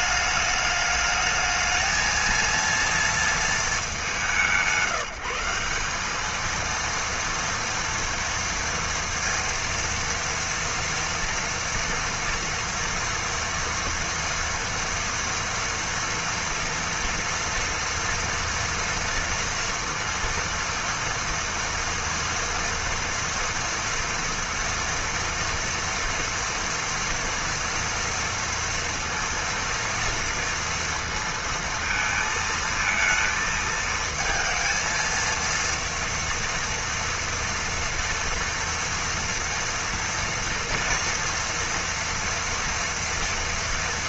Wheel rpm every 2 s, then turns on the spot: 210, 230, 160, 230, 230, 230, 230, 230, 230, 230, 230, 230, 230, 230, 230, 230, 230, 230, 230, 230, 230, 230.
none